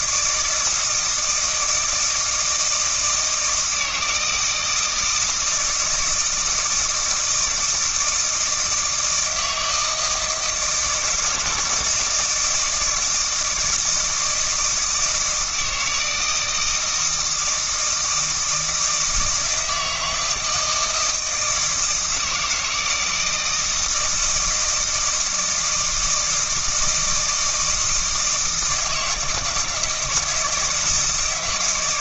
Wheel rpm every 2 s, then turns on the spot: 160, 160, 160, 160, 160, 160, 170, 160, 160, 160, 160, 160, 160, 160, 160, 160.
none